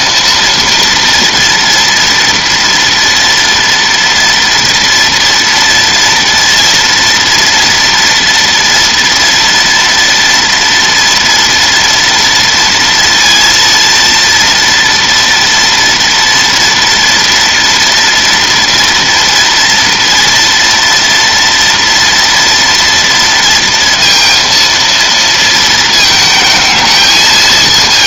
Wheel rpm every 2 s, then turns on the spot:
230, 230, 230, 230, 230, 230, 230, 230, 230, 230, 230, 230, 230, 220.
none